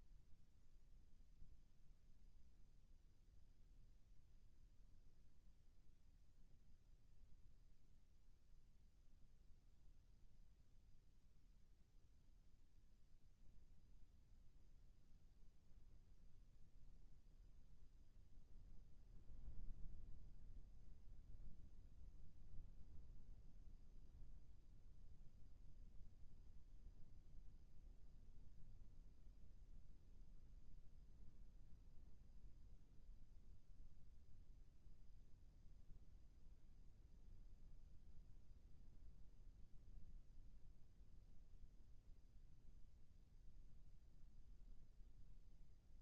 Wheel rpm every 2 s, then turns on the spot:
0, 0, 0, 0, 0, 0, 0, 0, 0, 0, 0, 0, 0, 0, 0, 0, 0, 0, 0, 0, 0, 0, 0.
none